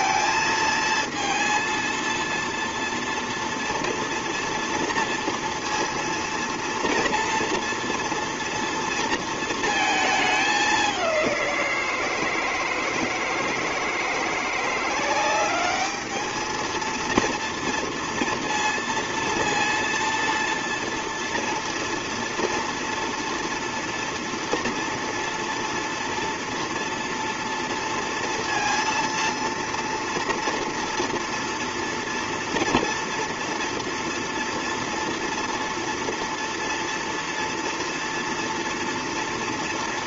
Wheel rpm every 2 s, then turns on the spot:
230, 230, 230, 230, 230, 200, 160, 180, 220, 230, 230, 240, 240, 230, 230, 230, 230, 230, 230, 230.
none